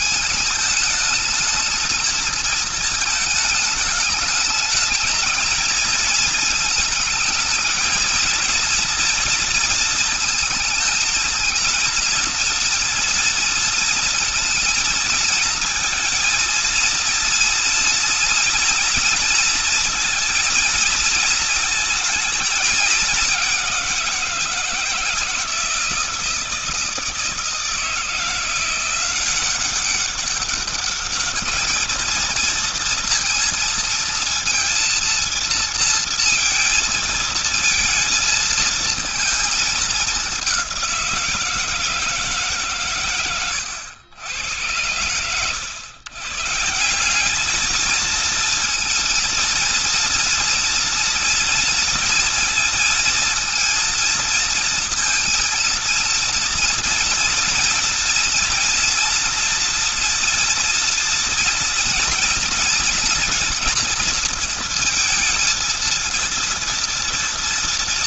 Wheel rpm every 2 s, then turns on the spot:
220, 220, 210, 220, 230, 220, 230, 230, 230, 240, 230, 210, 160, 160, 170, 200, 230, 230, 230, 220, 180, 130, 100, 170, 230, 230, 230, 230, 230, 230, 240, 240, 230, 230.
none